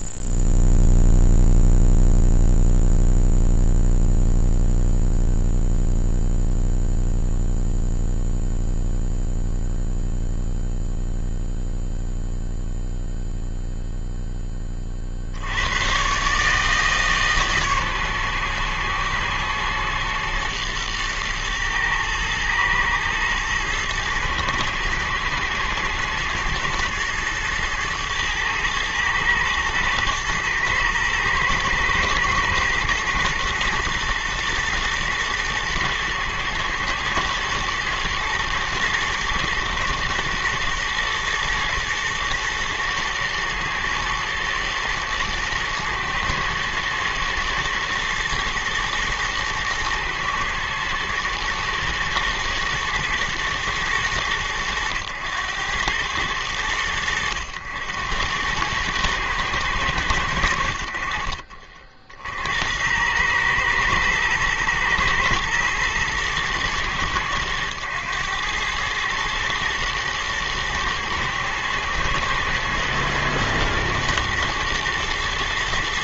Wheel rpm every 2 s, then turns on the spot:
0, 0, 0, 0, 0, 0, 0, 10, 140, 120, 120, 110, 120, 120, 110, 110, 110, 120, 110, 110, 120, 120, 110, 110, 110, 110, 120, 110, 100, 100, 80, 80, 110, 110, 110, 110, 120, 110.
none